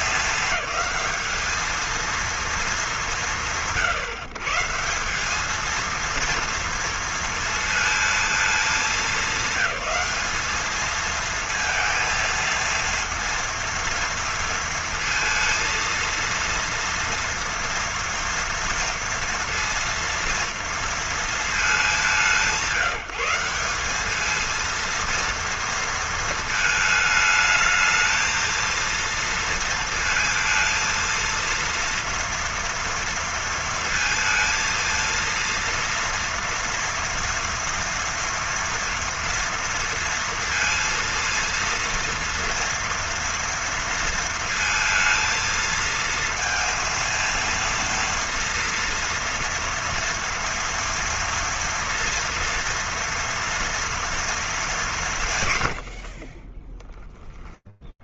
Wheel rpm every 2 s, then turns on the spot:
210, 220, 150, 230, 210, 210, 230, 230, 230, 230, 230, 170, 220, 220, 220, 230, 230, 230, 230, 240, 230, 230, 230, 230, 230, 230, 230, 230, 70.
56-58